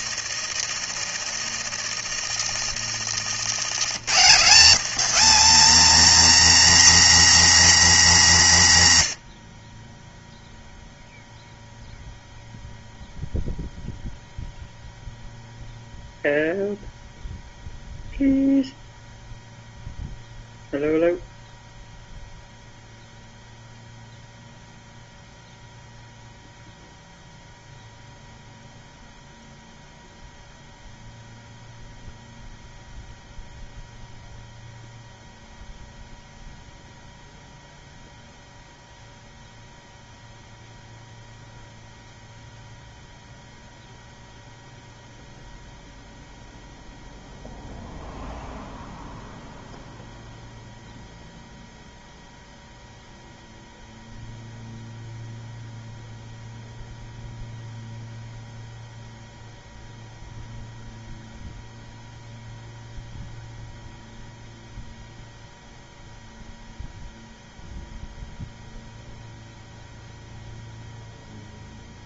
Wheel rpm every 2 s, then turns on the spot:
90, 90, 190, 270, 110, 0, 0, 0, 0, 0, 0, 0, 0, 0, 0, 0, 0, 0, 0, 0, 0, 0, 0, 0, 0, 0, 0, 0, 0, 0, 0, 0, 0, 0, 0, 0.
0-2